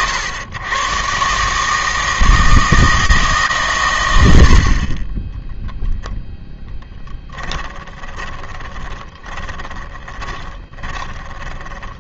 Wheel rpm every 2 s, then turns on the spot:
100, 160, 90, 10, 10, 20.
8-12